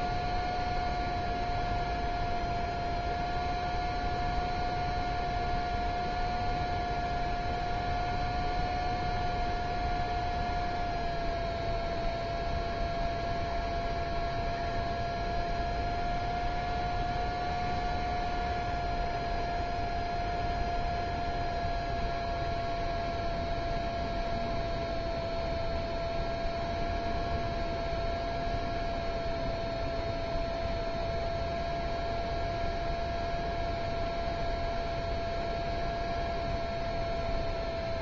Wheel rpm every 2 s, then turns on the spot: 0, 0, 0, 0, 0, 0, 0, 0, 0, 0, 0, 0, 0, 0, 0, 0, 0, 0, 0.
none